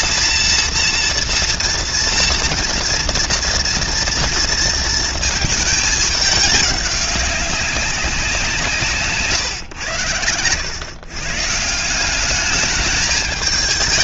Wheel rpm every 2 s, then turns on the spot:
230, 230, 230, 200, 140, 120, 220.
none